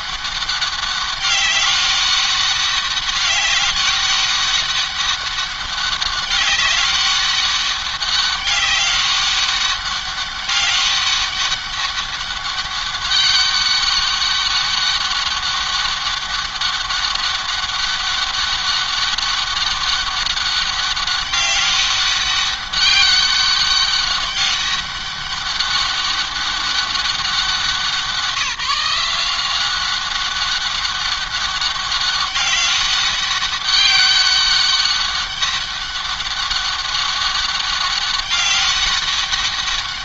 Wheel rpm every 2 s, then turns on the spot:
200, 200, 200, 190, 190, 200, 200, 200, 200, 200, 200, 200, 200, 200, 180, 200, 200, 200, 200, 200.
none